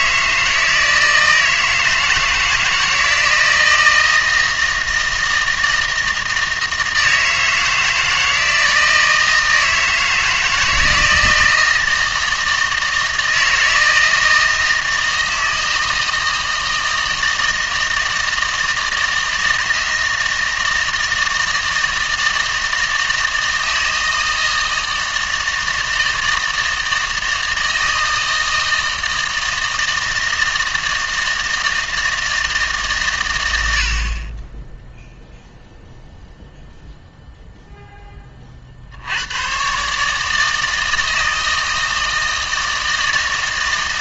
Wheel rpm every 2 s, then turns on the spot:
160, 160, 160, 160, 160, 160, 160, 160, 160, 160, 160, 160, 160, 160, 160, 160, 150, 10, 0, 50, 160, 160.
none